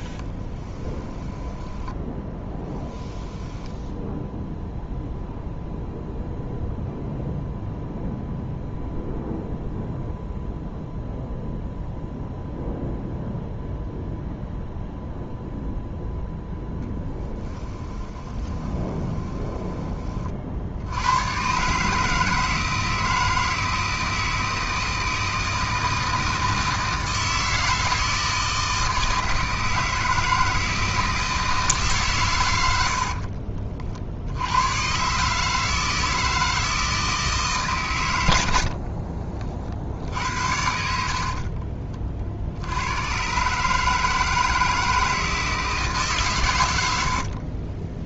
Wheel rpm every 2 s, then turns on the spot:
20, 10, 0, 0, 0, 0, 0, 0, 0, 20, 80, 160, 160, 160, 160, 160, 70, 120, 160, 70, 70, 90, 160, 100.
0-4 18-20 32-34 38-40